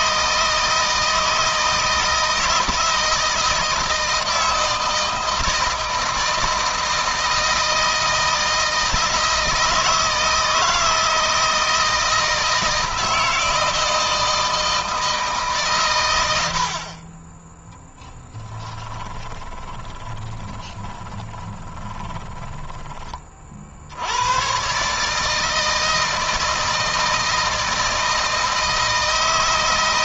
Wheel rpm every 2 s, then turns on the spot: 160, 160, 160, 160, 160, 160, 160, 160, 40, 10, 20, 30, 140, 160, 160.
18-22